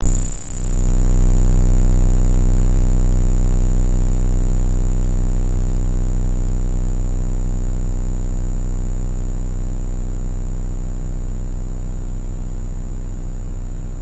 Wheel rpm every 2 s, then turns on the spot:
0, 0, 0, 0, 0, 0, 0.
none